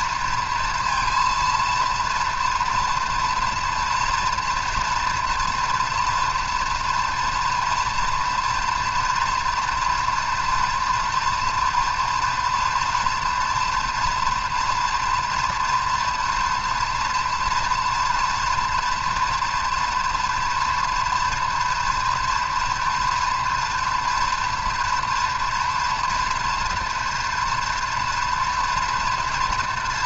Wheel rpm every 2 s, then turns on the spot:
230, 240, 230, 230, 240, 230, 230, 230, 230, 230, 230, 230, 230, 230, 230.
none